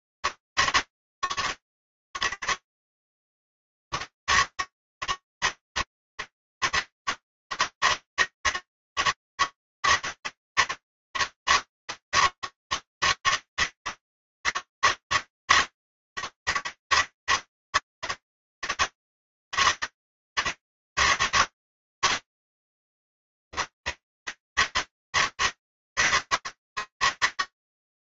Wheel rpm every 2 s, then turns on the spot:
150, 140, 150, 140, 160, 160, 160, 160, 160, 160, 140, 150, 130, 140.
none